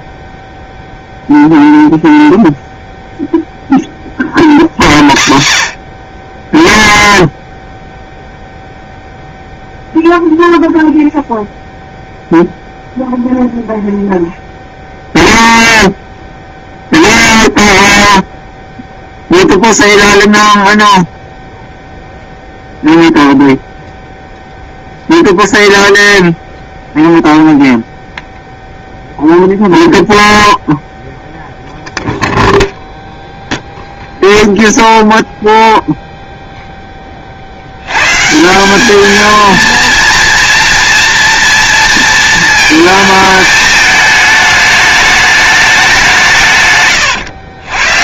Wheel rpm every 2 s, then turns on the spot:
0, 0, 40, 10, 0, 0, 0, 0, 0, 0, 0, 0, 0, 0, 0, 0, 0, 0, 0, 170, 230, 220, 210, 140.
none